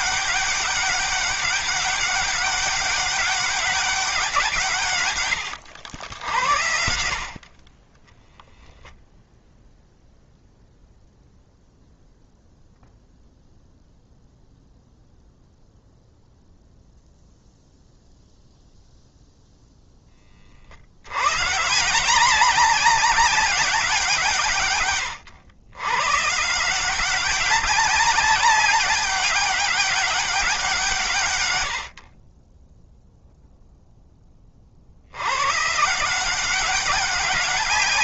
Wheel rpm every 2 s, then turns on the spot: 200, 200, 140, 70, 0, 0, 0, 0, 0, 0, 70, 200, 130, 180, 200, 170, 10, 60, 190.
none